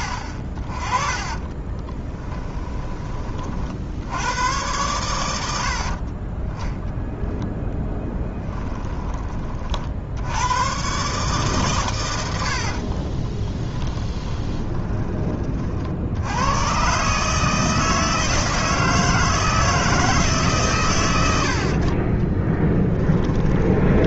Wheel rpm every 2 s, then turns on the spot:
30, 20, 110, 10, 10, 120, 40, 20, 120, 160, 130, 20.
2-4 8-10 12-16 22-24